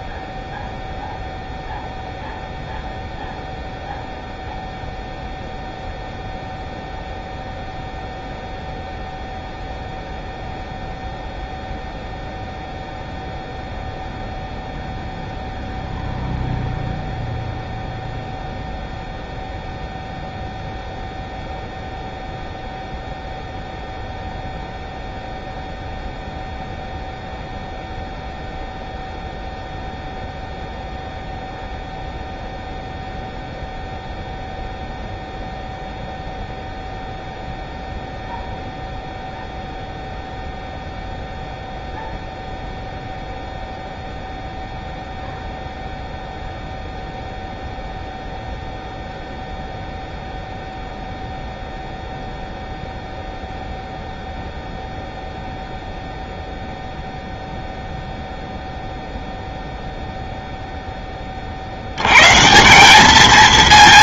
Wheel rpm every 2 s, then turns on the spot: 0, 0, 0, 0, 0, 0, 0, 0, 0, 0, 0, 0, 0, 0, 0, 0, 0, 0, 0, 0, 0, 0, 0, 0, 0, 0, 0, 0, 0, 0, 0, 160.
none